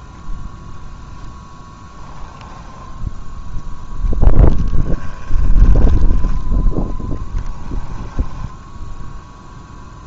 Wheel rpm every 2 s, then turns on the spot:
0, 10, 10, 10, 0.
2-6